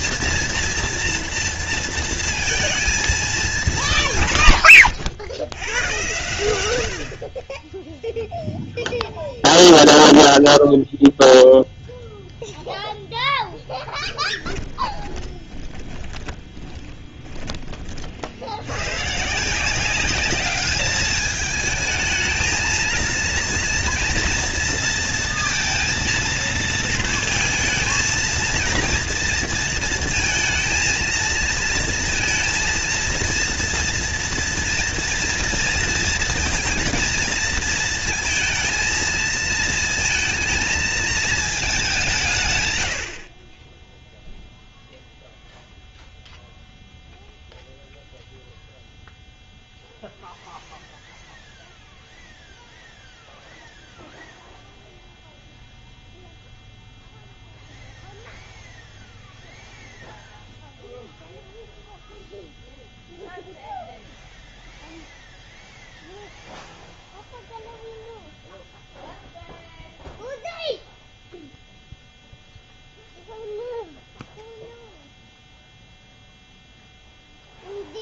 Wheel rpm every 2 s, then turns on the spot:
230, 220, 100, 50, 0, 0, 0, 20, 10, 140, 210, 230, 230, 230, 230, 230, 230, 230, 230, 230, 220, 60, 0, 0, 0, 0, 0, 0, 0, 0, 0, 0, 0, 0, 0, 0, 0, 0, 0.
14-16 42-44